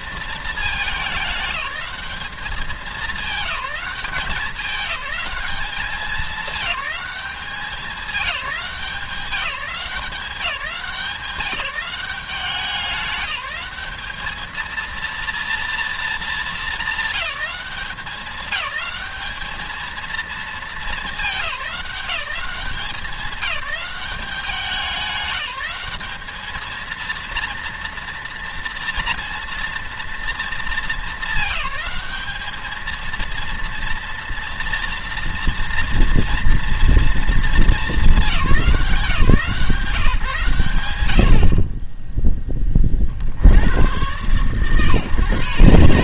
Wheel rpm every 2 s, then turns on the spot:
210, 210, 200, 210, 190, 180, 180, 220, 220, 210, 220, 200, 200, 220, 230, 220, 220, 230, 230, 180, 100, 30, 140.
none